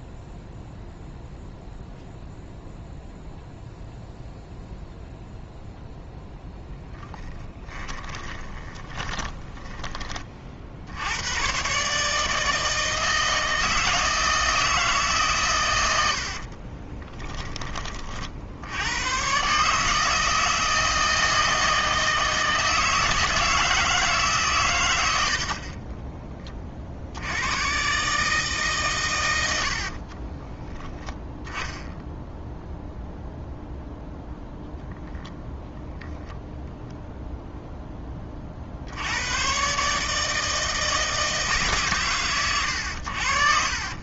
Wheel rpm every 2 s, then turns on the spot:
0, 0, 0, 20, 10, 70, 160, 160, 20, 90, 160, 160, 110, 50, 130, 20, 0, 0, 0, 70, 160, 90.
6-10 16-18